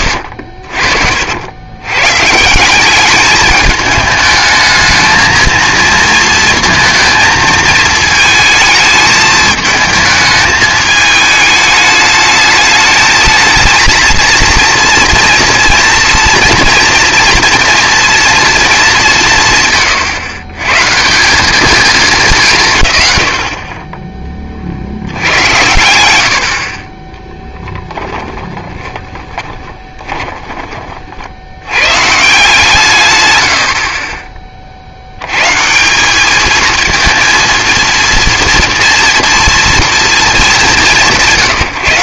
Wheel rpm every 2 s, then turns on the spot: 70, 180, 220, 230, 220, 210, 210, 230, 230, 210, 120, 130, 70, 50, 20, 30, 150, 50, 220, 230, 210.
28-30